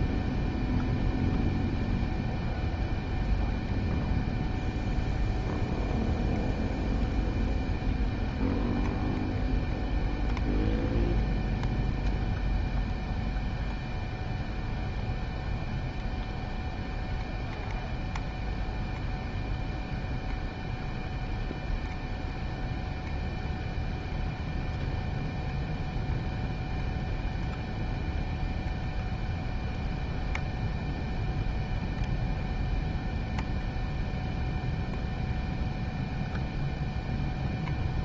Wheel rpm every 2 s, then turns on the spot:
0, 0, 0, 0, 0, 0, 0, 0, 0, 0, 0, 0, 0, 0, 0, 0, 0, 0, 0.
none